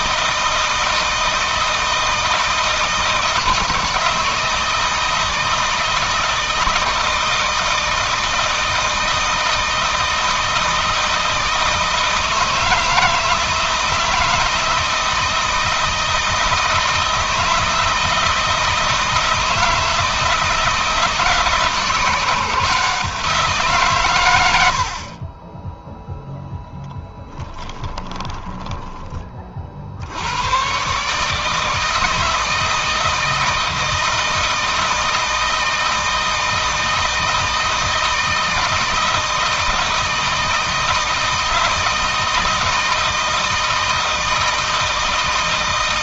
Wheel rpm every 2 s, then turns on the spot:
160, 160, 160, 160, 160, 160, 160, 160, 160, 160, 160, 160, 80, 10, 10, 120, 160, 160, 160, 160, 160, 160, 160.
28-30